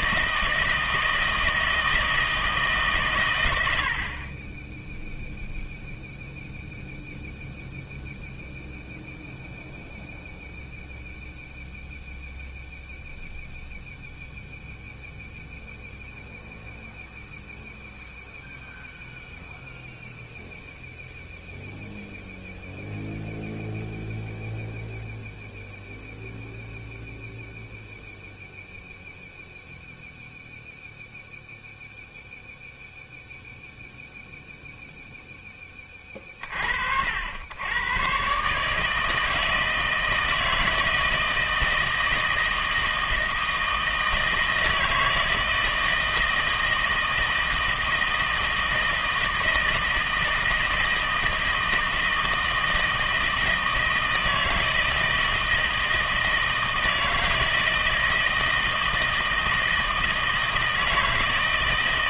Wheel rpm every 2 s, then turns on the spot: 160, 160, 10, 0, 0, 0, 0, 0, 0, 0, 0, 0, 0, 0, 0, 0, 0, 0, 50, 140, 160, 160, 160, 160, 160, 160, 160, 160, 160, 160, 160.
none